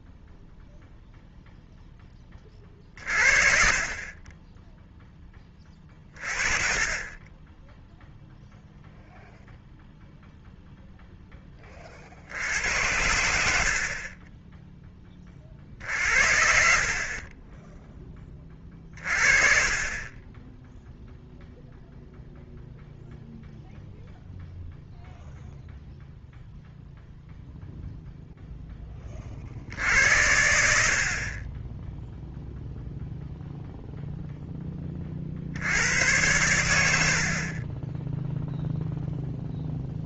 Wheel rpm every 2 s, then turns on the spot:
0, 40, 10, 30, 0, 0, 90, 20, 40, 20, 0, 0, 0, 0, 10, 70, 0, 20, 90, 0.
none